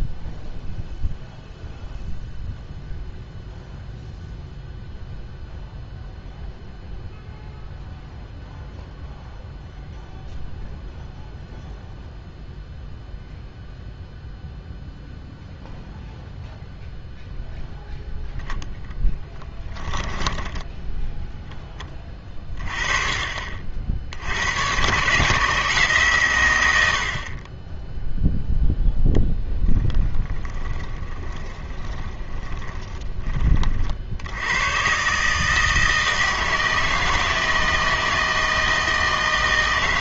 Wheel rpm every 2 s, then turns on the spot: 0, 0, 0, 0, 0, 0, 0, 0, 0, 0, 10, 20, 110, 90, 0, 20, 20, 120, 160, 160.
30-34